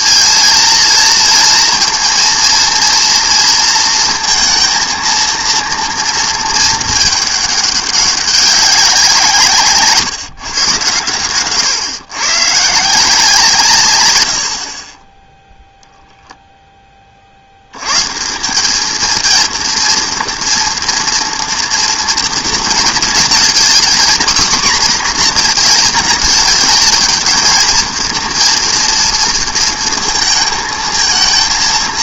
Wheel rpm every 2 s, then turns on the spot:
230, 230, 230, 220, 190, 130, 140, 60, 10, 200, 230, 220, 250, 220, 230, 220.
none